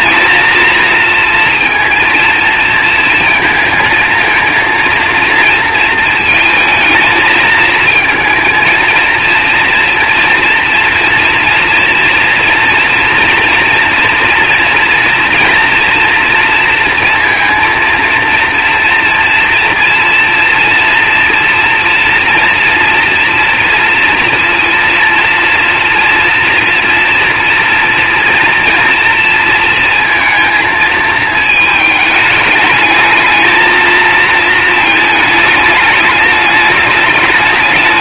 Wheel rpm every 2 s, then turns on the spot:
230, 230, 230, 220, 230, 240, 230, 230, 230, 230, 230, 230, 230, 230, 230, 230, 210, 220, 210.
none